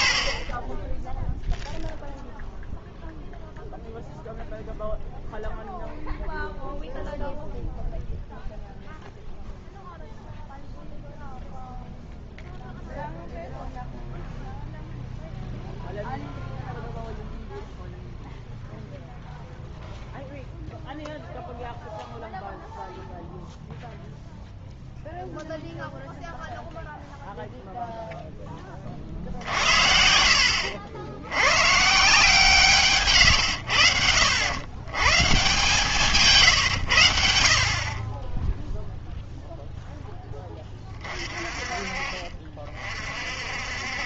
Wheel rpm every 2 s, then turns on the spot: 20, 0, 0, 0, 0, 0, 0, 0, 0, 0, 0, 0, 0, 0, 30, 70, 160, 100, 130, 0, 20, 30.
0-2